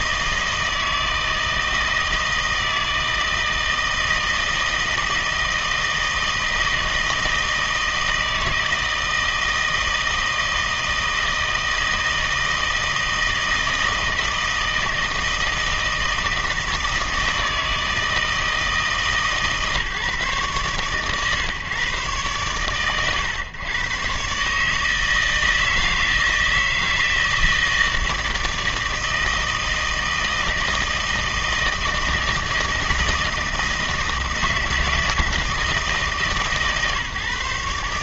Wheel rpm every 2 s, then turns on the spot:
160, 160, 160, 160, 160, 160, 160, 160, 160, 160, 140, 120, 150, 160, 160, 160, 160, 160, 140.
none